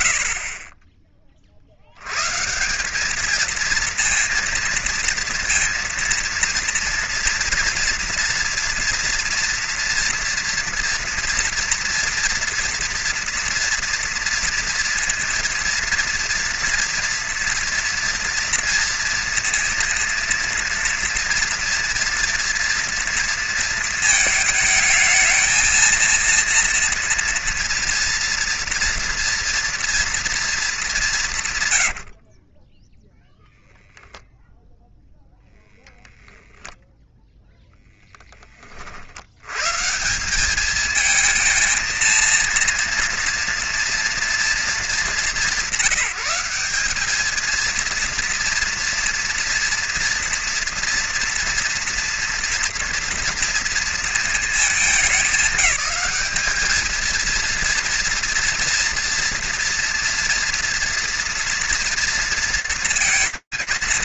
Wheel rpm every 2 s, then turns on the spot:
30, 160, 230, 230, 230, 230, 230, 230, 230, 230, 230, 230, 220, 230, 230, 220, 30, 0, 0, 10, 190, 230, 230, 180, 230, 230, 230, 230, 200, 240, 230, 230.
32-34